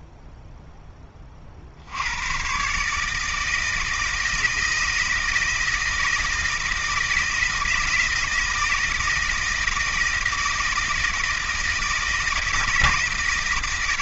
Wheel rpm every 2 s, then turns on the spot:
10, 140, 160, 160, 160, 160, 160.
none